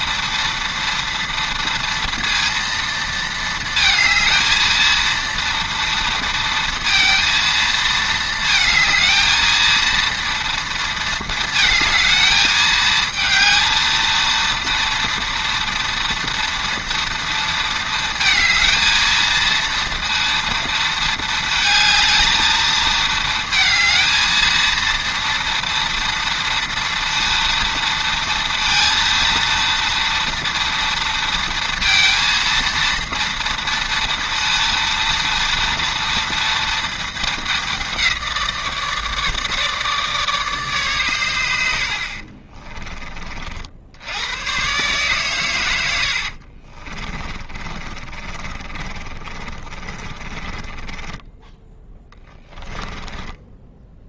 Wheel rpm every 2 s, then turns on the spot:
230, 230, 230, 230, 220, 230, 220, 230, 230, 230, 230, 220, 230, 230, 230, 230, 230, 230, 220, 160, 120, 30, 140, 40, 30, 20, 10.
46-54